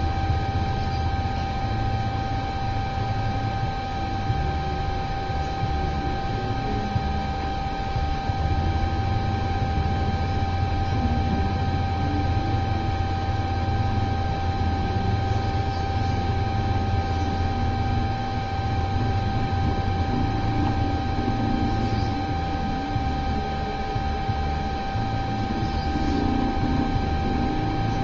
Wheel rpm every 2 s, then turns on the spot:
0, 0, 0, 0, 0, 0, 0, 0, 0, 0, 0, 0, 0, 0.
none